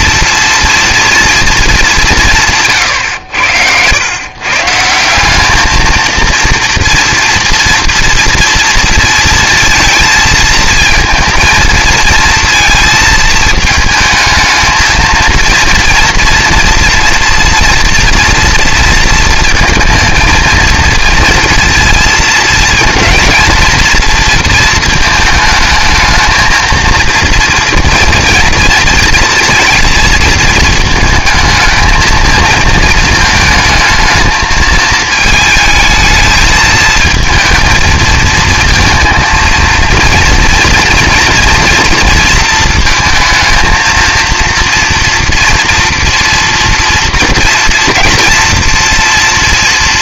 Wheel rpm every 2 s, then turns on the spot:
230, 140, 160, 230, 230, 230, 230, 220, 230, 230, 230, 230, 230, 230, 230, 220, 220, 220, 220, 230, 230, 230, 230, 230, 230.
none